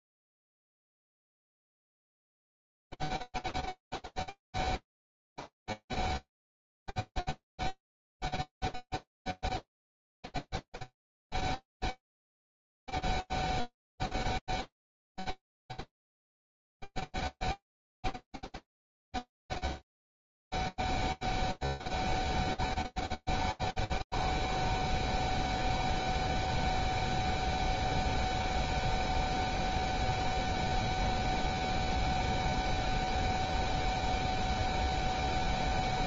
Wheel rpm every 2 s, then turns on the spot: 0, 0, 0, 0, 0, 0, 0, 0, 0, 0, 0, 0, 0, 0, 0, 0, 0, 0.
none